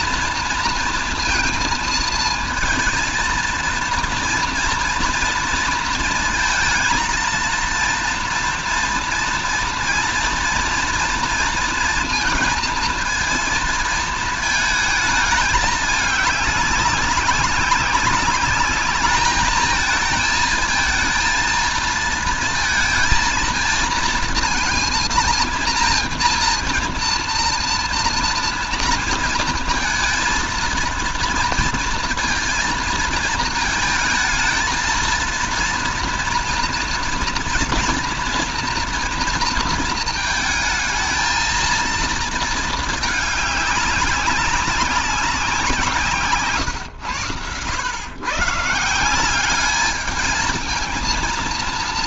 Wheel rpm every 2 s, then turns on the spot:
230, 220, 230, 230, 230, 230, 230, 220, 200, 210, 220, 220, 220, 230, 230, 230, 230, 220, 240, 230, 220, 220, 190, 120, 150, 220.
none